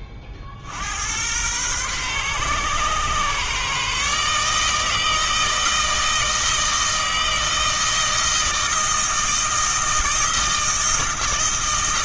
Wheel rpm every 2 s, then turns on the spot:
80, 130, 160, 160, 160, 160.
none